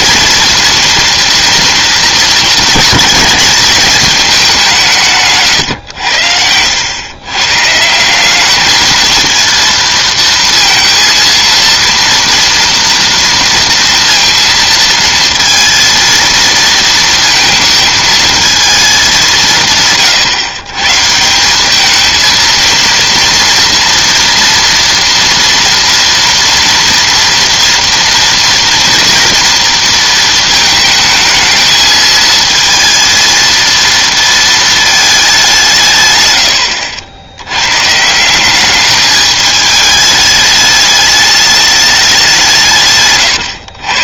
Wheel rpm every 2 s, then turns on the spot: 230, 220, 170, 100, 210, 230, 230, 230, 230, 220, 140, 230, 230, 230, 230, 220, 230, 220, 70, 200, 210, 150.
none